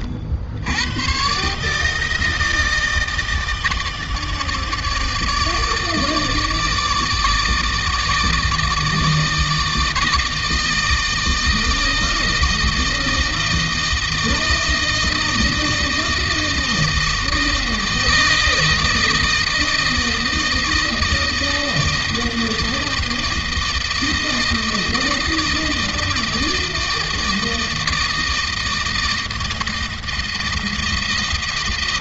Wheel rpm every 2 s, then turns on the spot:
90, 160, 160, 150, 160, 160, 160, 160, 160, 160, 160, 160, 160, 160, 160, 160.
none